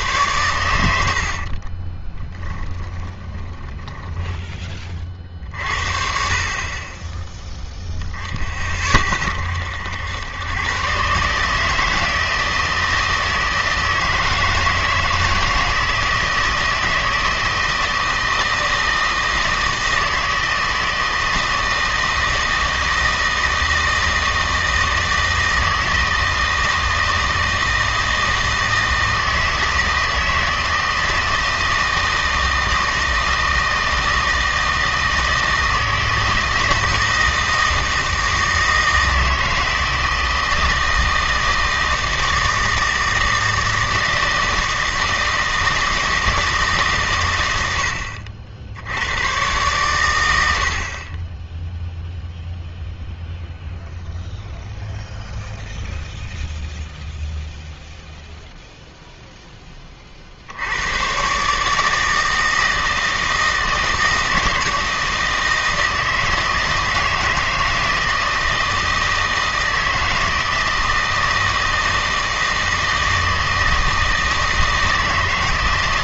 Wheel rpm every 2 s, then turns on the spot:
100, 10, 20, 30, 40, 120, 160, 160, 160, 160, 160, 160, 160, 160, 160, 160, 160, 160, 160, 160, 160, 160, 160, 150, 70, 60, 0, 0, 0, 0, 90, 160, 160, 160, 160, 160, 160, 160.
2-4